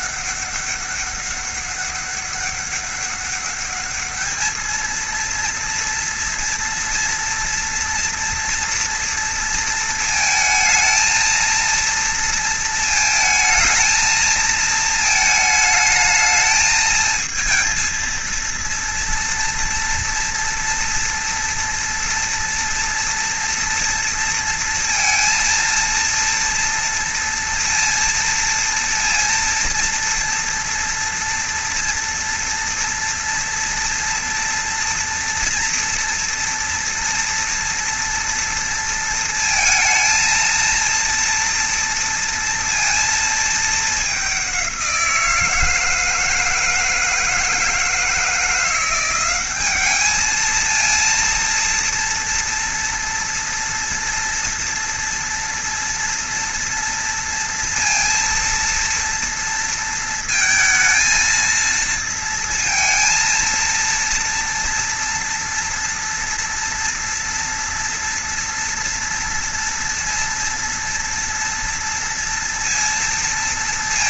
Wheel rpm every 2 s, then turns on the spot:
200, 200, 220, 230, 230, 220, 230, 220, 220, 230, 230, 230, 230, 230, 230, 230, 240, 230, 230, 230, 230, 230, 190, 160, 170, 220, 230, 230, 230, 230, 230, 230, 230, 230, 230, 230, 230.
none